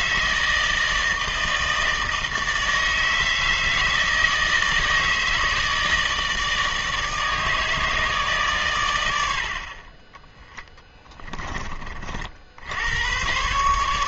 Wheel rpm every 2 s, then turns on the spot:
160, 160, 160, 150, 110, 20, 90.
10-12